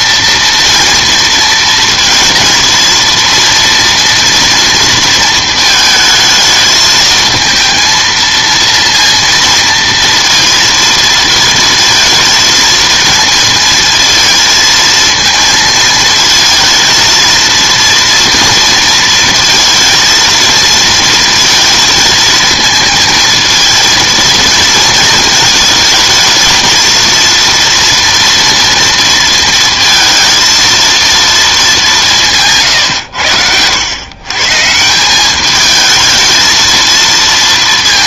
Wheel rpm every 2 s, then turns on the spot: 230, 230, 220, 220, 230, 230, 220, 230, 230, 230, 230, 230, 220, 230, 230, 210, 90, 210, 220.
none